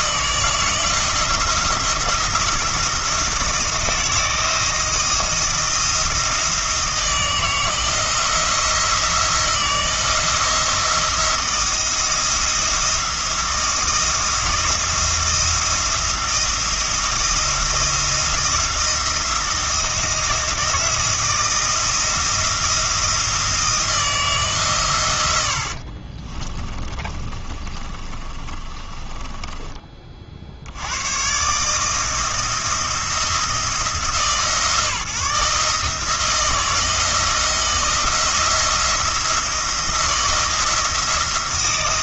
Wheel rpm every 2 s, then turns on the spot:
160, 170, 160, 160, 170, 170, 170, 170, 170, 170, 170, 170, 130, 30, 30, 100, 170, 160, 160, 170, 170.
26-30